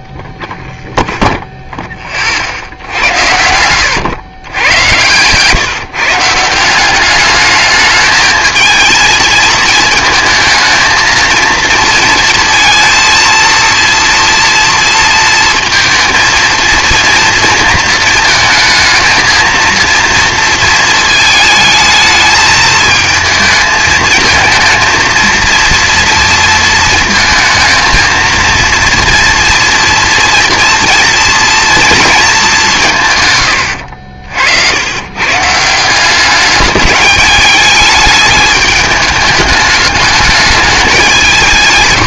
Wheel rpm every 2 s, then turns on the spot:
10, 50, 110, 170, 230, 230, 230, 230, 230, 220, 230, 220, 230, 230, 230, 230, 180, 80, 200, 210, 210.
0-2